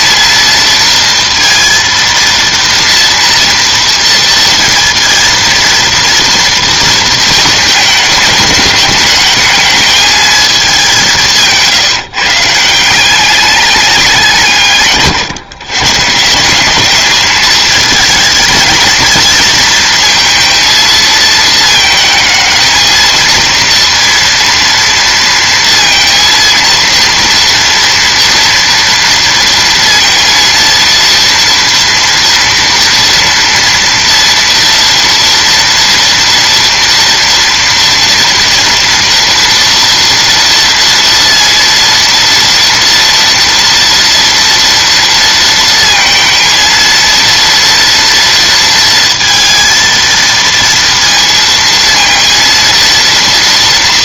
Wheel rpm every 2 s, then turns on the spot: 230, 230, 230, 230, 210, 200, 160, 160, 200, 220, 230, 220, 230, 230, 230, 230, 230, 230, 230, 230, 230, 230, 230, 230, 230, 230, 230.
none